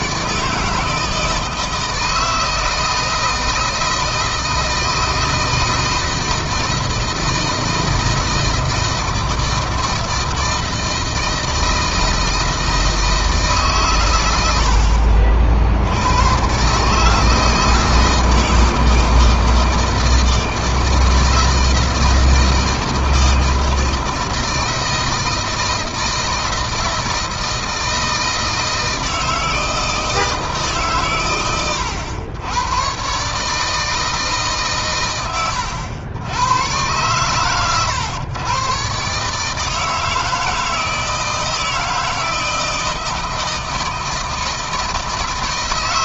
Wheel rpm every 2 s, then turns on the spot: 160, 160, 160, 160, 160, 160, 160, 70, 140, 160, 160, 160, 160, 160, 160, 130, 130, 130, 110, 130, 160, 160, 160.
none